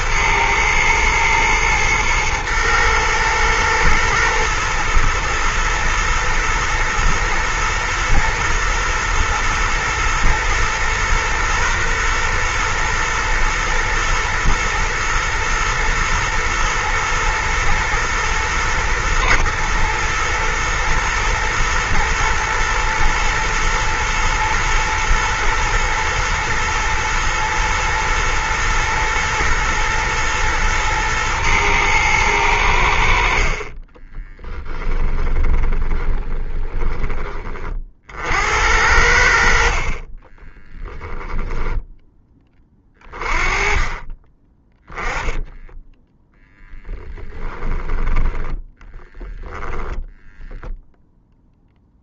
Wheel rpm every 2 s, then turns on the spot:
110, 120, 120, 110, 110, 120, 120, 120, 110, 120, 120, 110, 120, 120, 110, 110, 80, 20, 20, 70, 10, 20, 10, 10, 10, 0.
34-36 44-50